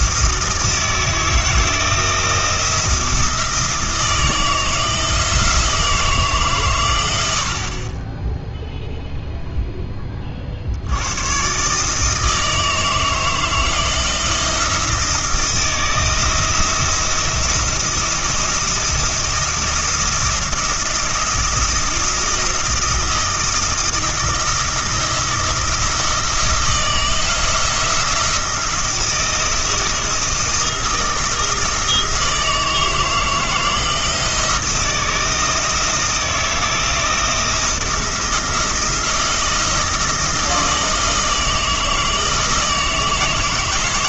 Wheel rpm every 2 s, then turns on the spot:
160, 170, 170, 120, 0, 70, 160, 160, 160, 170, 170, 170, 160, 170, 170, 170, 160, 170, 170, 170, 160, 160.
none